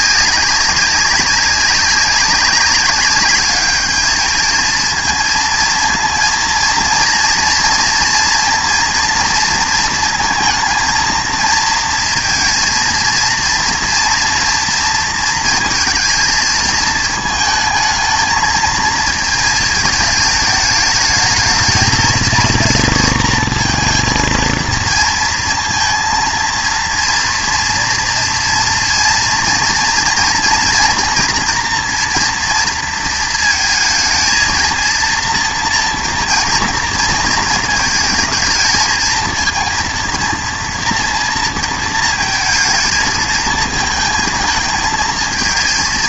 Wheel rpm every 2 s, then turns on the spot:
190, 190, 220, 230, 230, 230, 230, 230, 220, 230, 210, 230, 230, 230, 230, 240, 230, 230, 230, 220, 230, 220, 220.
none